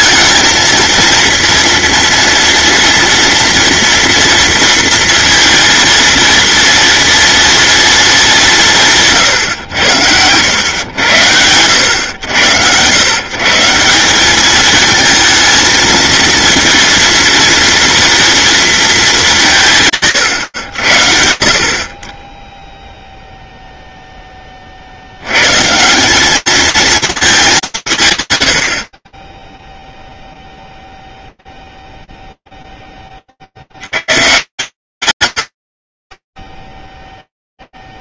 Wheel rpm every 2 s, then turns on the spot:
230, 230, 230, 230, 180, 100, 100, 220, 230, 220, 90, 0, 40, 220, 120, 0, 0, 130, 0.
none